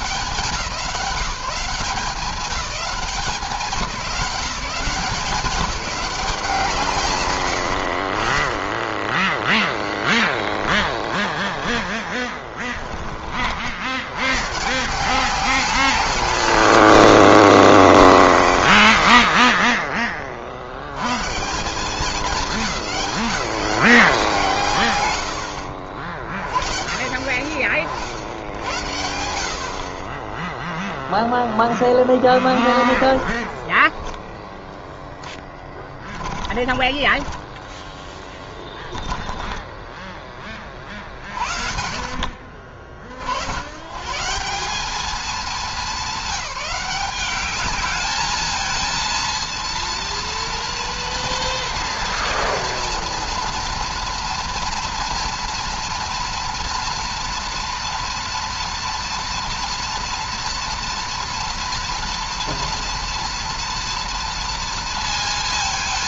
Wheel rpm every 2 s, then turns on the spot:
180, 200, 170, 150, 10, 10, 20, 170, 150, 90, 90, 210, 120, 80, 80, 0, 20, 10, 20, 10, 40, 60, 190, 200, 220, 240, 230, 230, 240, 240, 230, 230, 230.
10-12 32-40